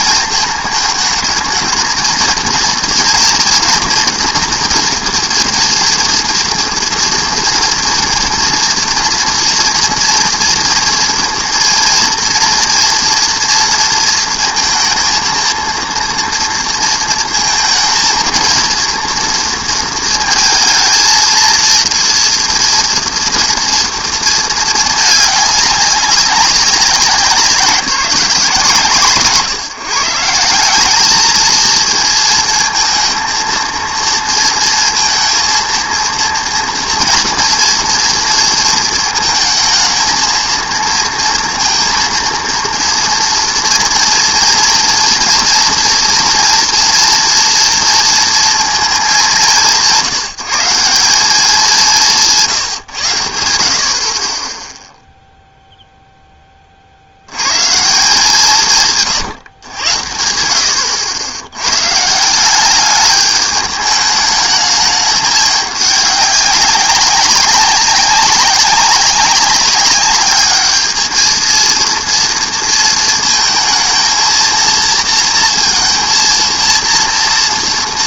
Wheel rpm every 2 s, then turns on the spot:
220, 230, 230, 230, 230, 230, 230, 230, 230, 230, 230, 230, 220, 190, 160, 180, 230, 230, 230, 230, 220, 230, 230, 230, 230, 170, 140, 20, 20, 170, 80, 200, 210, 200, 200, 210, 230, 230, 230.
none